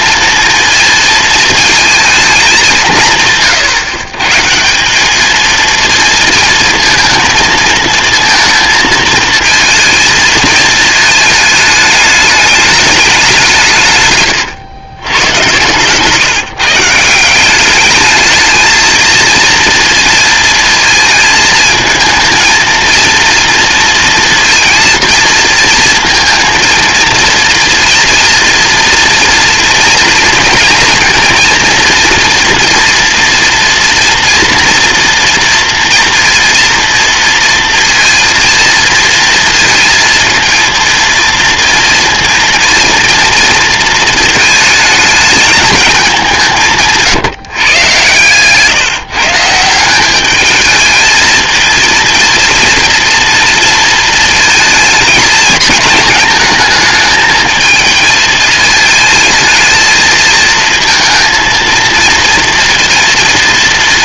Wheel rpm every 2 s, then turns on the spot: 230, 210, 150, 230, 230, 220, 210, 120, 150, 220, 230, 230, 230, 230, 230, 230, 230, 230, 230, 230, 230, 230, 230, 180, 130, 210, 230, 220, 220, 220, 230, 230.
none